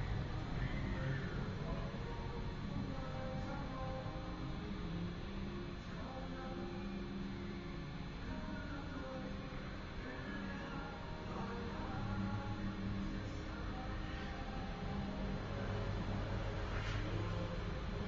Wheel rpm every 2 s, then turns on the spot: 0, 0, 0, 0, 0, 0, 0, 0, 0.
none